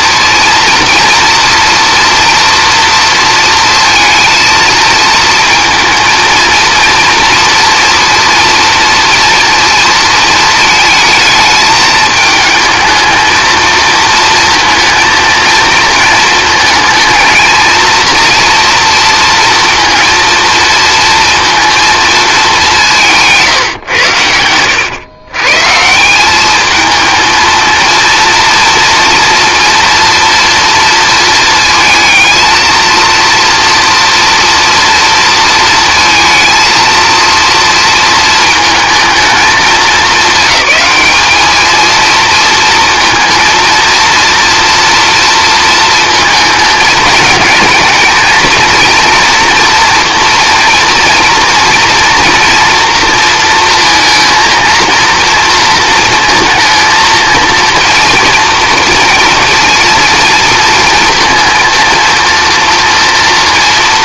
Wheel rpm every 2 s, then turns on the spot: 230, 230, 230, 230, 230, 220, 220, 230, 220, 240, 230, 190, 100, 210, 230, 230, 230, 230, 230, 230, 210, 230, 230, 220, 230, 230, 230, 230, 230, 230, 230, 230.
none